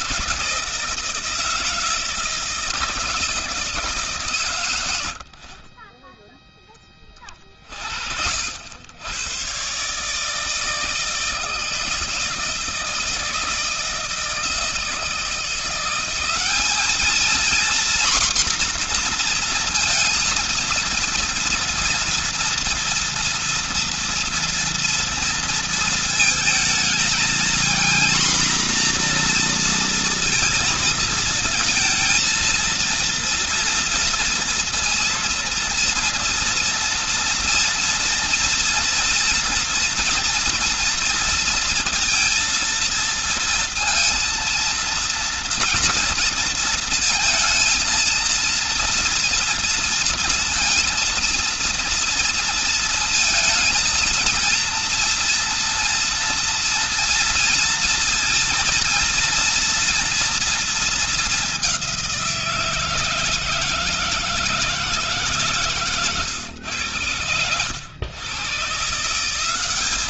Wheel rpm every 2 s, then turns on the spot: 160, 160, 120, 10, 70, 160, 160, 160, 200, 250, 230, 230, 230, 220, 240, 230, 230, 230, 230, 230, 230, 230, 230, 230, 230, 230, 230, 230, 240, 230, 230, 170, 160, 120, 130.
none